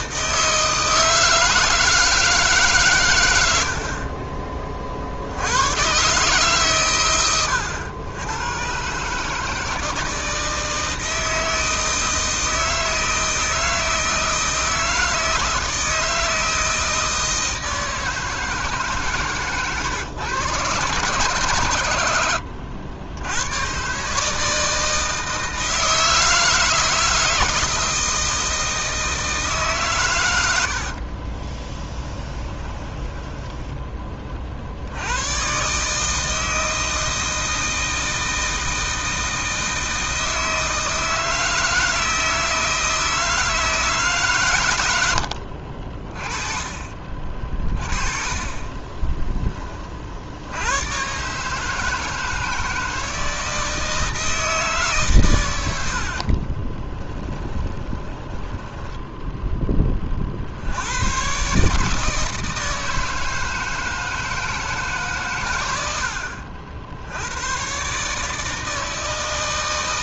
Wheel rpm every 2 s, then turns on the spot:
160, 130, 40, 130, 130, 160, 160, 160, 160, 150, 120, 80, 160, 160, 160, 70, 20, 60, 160, 160, 160, 160, 100, 40, 20, 100, 160, 150, 20, 10, 80, 160, 150, 70, 160.
30-34 48-50 56-60